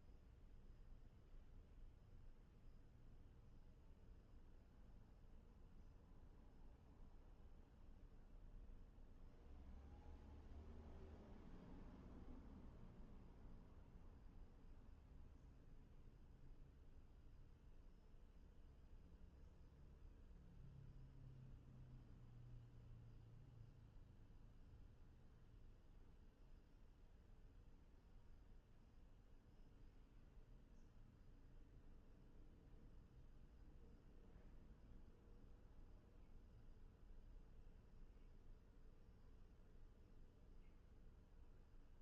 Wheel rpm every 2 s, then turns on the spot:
0, 0, 0, 0, 0, 0, 0, 0, 0, 0, 0, 0, 0, 0, 0, 0, 0, 0, 0, 0, 0.
none